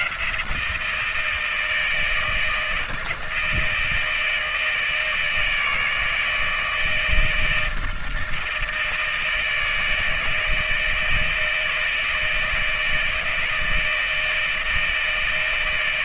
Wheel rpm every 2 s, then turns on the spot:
170, 160, 160, 160, 160, 160, 160, 160.
none